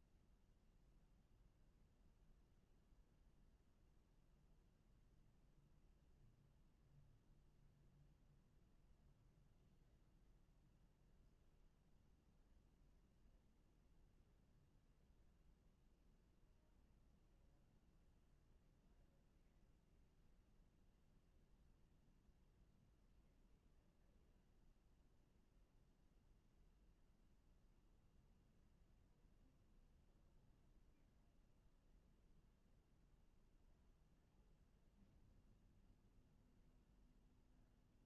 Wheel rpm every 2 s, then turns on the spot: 0, 0, 0, 0, 0, 0, 0, 0, 0, 0, 0, 0, 0, 0, 0, 0, 0, 0, 0.
none